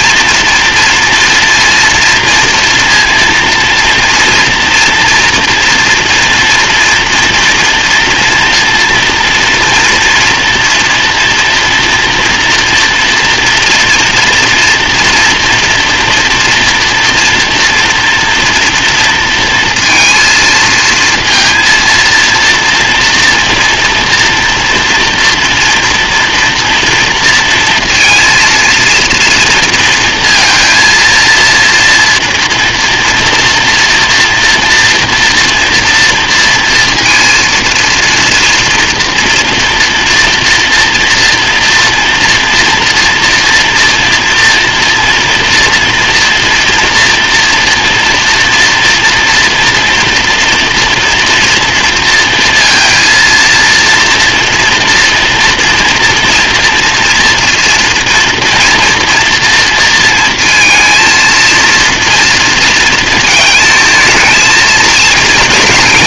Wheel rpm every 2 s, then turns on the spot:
230, 230, 230, 230, 240, 230, 240, 230, 230, 240, 230, 230, 230, 230, 230, 230, 230, 240, 230, 230, 230, 230, 230, 230, 230, 230, 230, 230, 230, 230, 230, 230, 220.
none